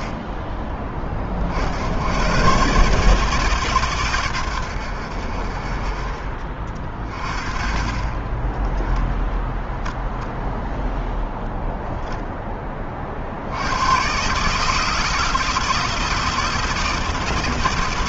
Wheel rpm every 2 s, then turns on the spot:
50, 150, 50, 40, 0, 0, 80, 160, 140.
none